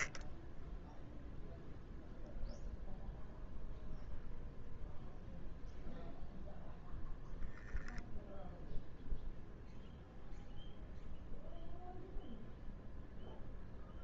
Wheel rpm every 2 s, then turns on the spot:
10, 0, 0, 0, 0, 0, 0.
none